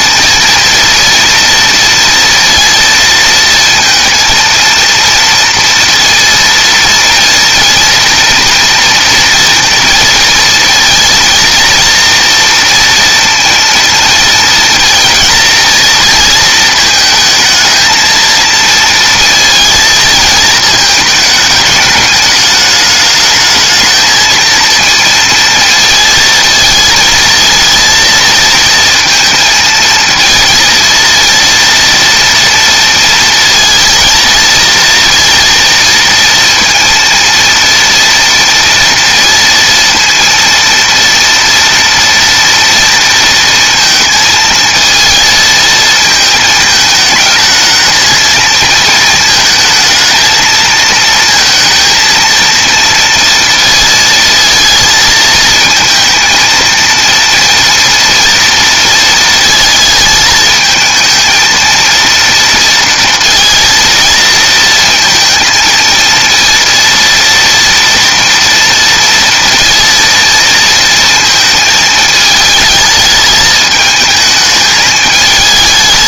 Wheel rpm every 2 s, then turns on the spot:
230, 230, 230, 230, 230, 230, 230, 230, 230, 230, 220, 210, 220, 220, 230, 230, 230, 230, 230, 230, 230, 240, 220, 220, 220, 220, 230, 230, 220, 230, 220, 230, 230, 230, 230, 230, 220, 220.
none